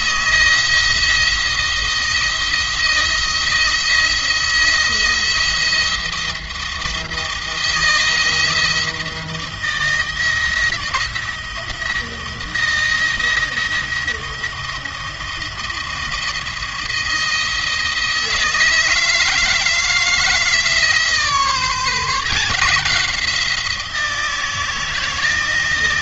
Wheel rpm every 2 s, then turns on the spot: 170, 160, 170, 170, 160, 170, 170, 170, 170, 160, 160, 170, 160.
none